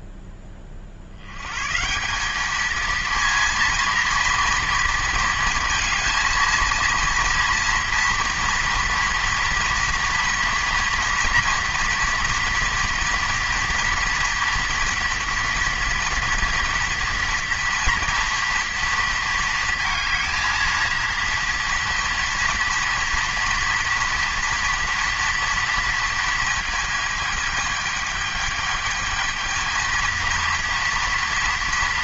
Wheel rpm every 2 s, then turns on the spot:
30, 220, 230, 230, 230, 230, 230, 230, 230, 230, 230, 230, 230, 220, 210, 230.
none